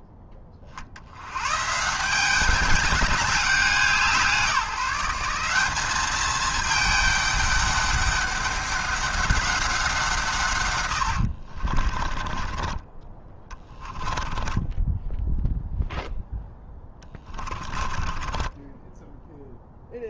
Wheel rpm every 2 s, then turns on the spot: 50, 200, 180, 210, 200, 110, 20, 10, 10, 10.
10-12 14-20